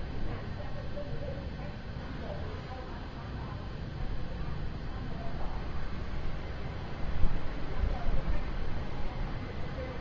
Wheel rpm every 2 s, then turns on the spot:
0, 0, 0, 0, 0.
none